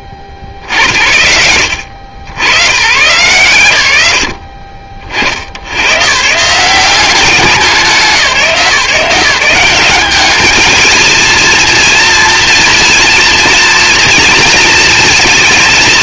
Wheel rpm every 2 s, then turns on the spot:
60, 110, 60, 170, 160, 220, 240, 230.
none